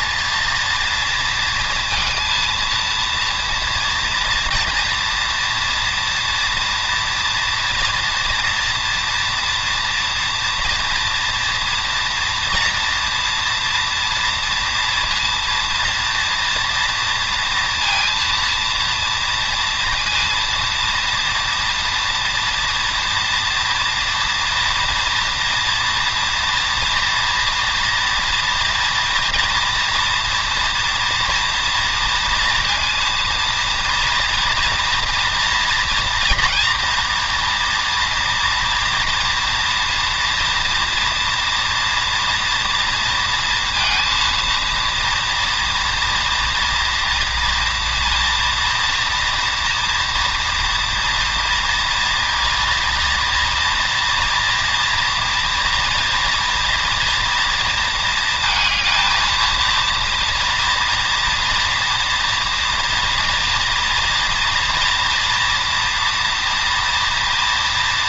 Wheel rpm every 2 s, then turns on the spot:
230, 230, 230, 230, 240, 240, 240, 230, 230, 230, 230, 230, 230, 230, 230, 230, 230, 230, 240, 230, 240, 230, 230, 230, 230, 230, 230, 230, 230, 220, 240, 230, 230, 230.
none